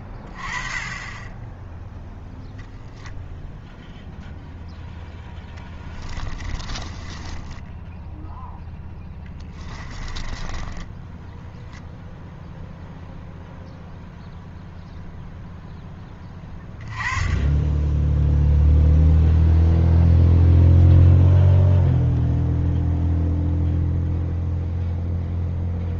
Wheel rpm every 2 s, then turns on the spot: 20, 0, 0, 20, 0, 10, 0, 0, 20, 0, 0, 0, 0.
6-8 10-12